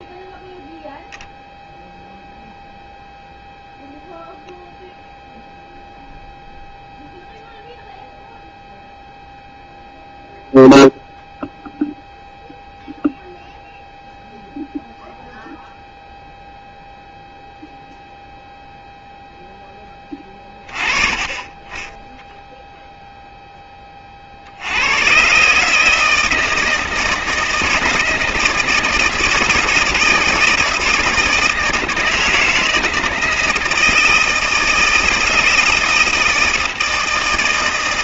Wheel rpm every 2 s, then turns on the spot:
0, 0, 0, 0, 0, 0, 0, 0, 0, 0, 20, 0, 70, 160, 160, 170, 160, 160, 160.
none